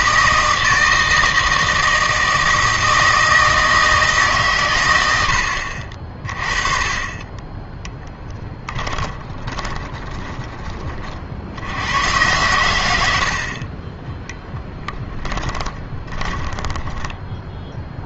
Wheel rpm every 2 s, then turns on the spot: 160, 160, 120, 30, 10, 20, 100, 10, 10.
8-10 12-18